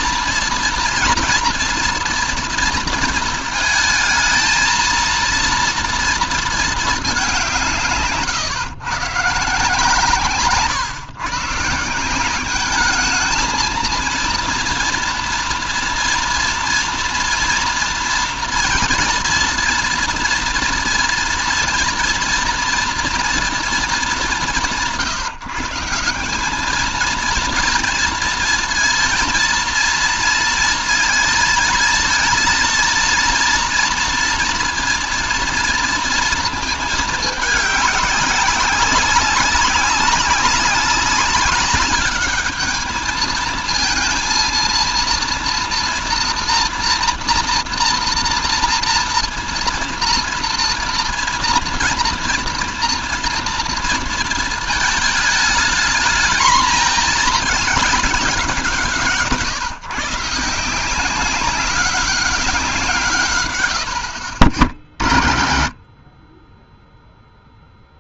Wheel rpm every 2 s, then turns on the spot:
230, 230, 220, 220, 140, 140, 190, 230, 230, 230, 230, 240, 170, 200, 230, 230, 230, 230, 230, 200, 200, 210, 230, 230, 230, 230, 230, 220, 220, 150, 170, 170, 80, 30.
none